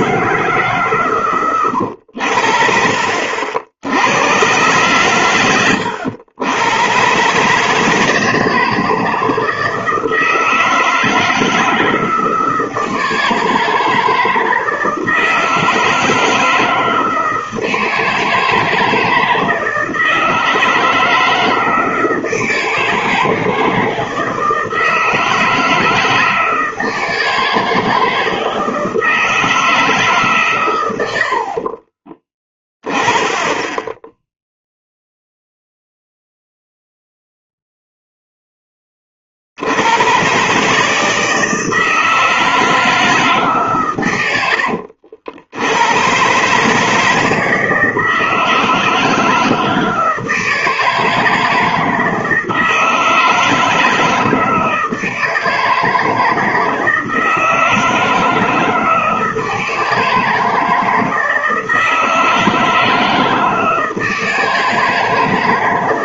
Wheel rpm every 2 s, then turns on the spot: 150, 60, 110, 110, 160, 160, 160, 160, 160, 160, 160, 160, 160, 170, 160, 130, 20, 0, 0, 10, 140, 160, 100, 140, 160, 160, 170, 160, 160, 160, 160, 160, 160.
none